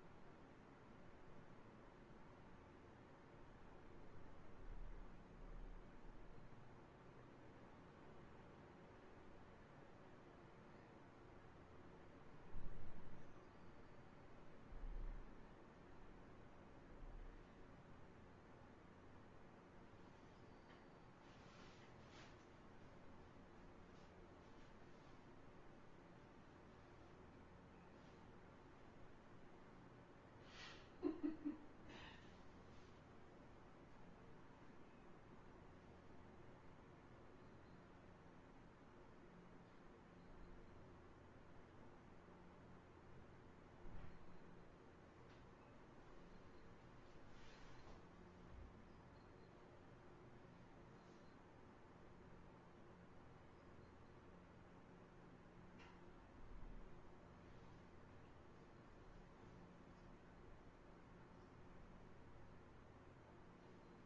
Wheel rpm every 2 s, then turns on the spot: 0, 0, 0, 0, 0, 0, 0, 0, 0, 0, 0, 0, 0, 0, 0, 0, 0, 0, 0, 0, 0, 0, 0, 0, 0, 0, 0, 0, 0, 0, 0, 0.
none